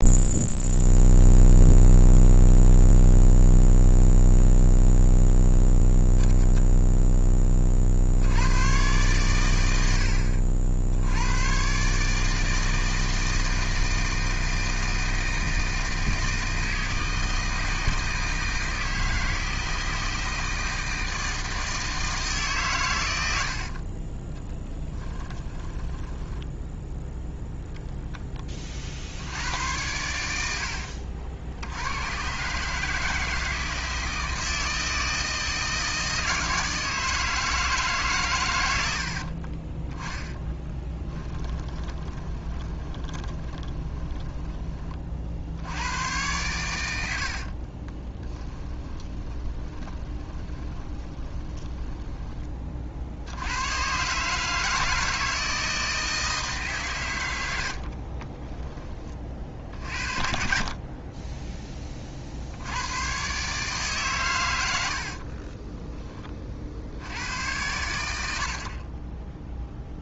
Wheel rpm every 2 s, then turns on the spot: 0, 0, 0, 0, 110, 90, 160, 160, 160, 160, 160, 110, 10, 0, 60, 60, 150, 160, 160, 80, 10, 20, 30, 90, 20, 20, 50, 160, 130, 30, 30, 110, 80, 80, 30.
24-26 30-32 38-44 48-52 64-66